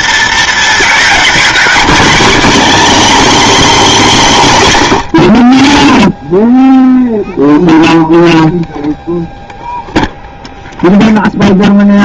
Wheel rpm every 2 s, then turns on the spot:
230, 260, 220, 30, 0, 0.
none